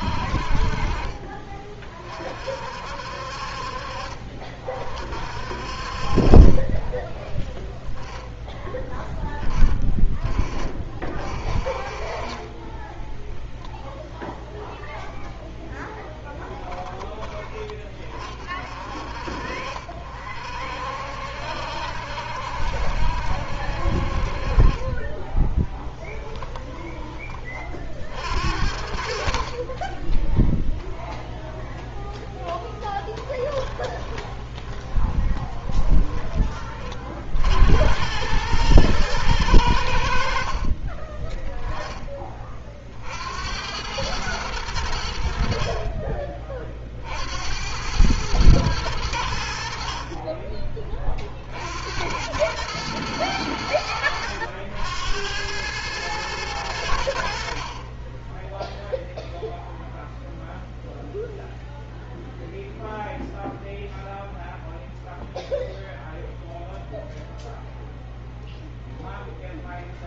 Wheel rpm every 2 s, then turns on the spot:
40, 50, 50, 20, 10, 40, 20, 0, 20, 40, 60, 70, 30, 20, 50, 0, 10, 20, 40, 110, 30, 40, 90, 50, 100, 30, 100, 80, 90, 0, 0, 0, 0, 0, 0.
6-8 12-14 24-26 32-36